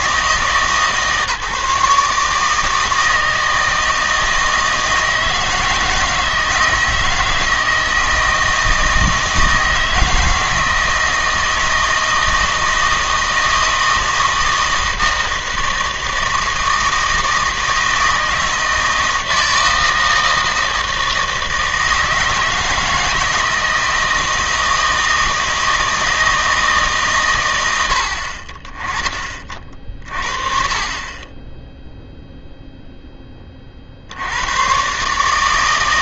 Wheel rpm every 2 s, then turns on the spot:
150, 160, 160, 160, 160, 160, 160, 160, 160, 160, 160, 160, 160, 160, 30, 40, 0, 130.
none